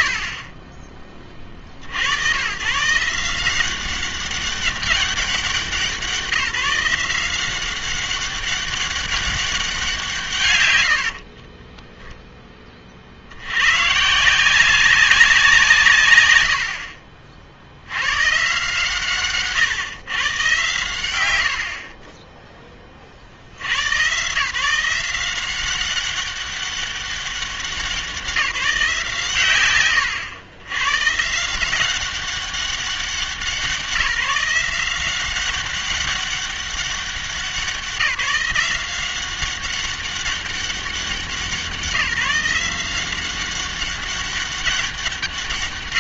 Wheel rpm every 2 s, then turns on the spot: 50, 130, 200, 170, 190, 100, 30, 180, 100, 140, 80, 10, 150, 200, 180, 120, 190, 170, 200, 180, 190, 170, 200.
none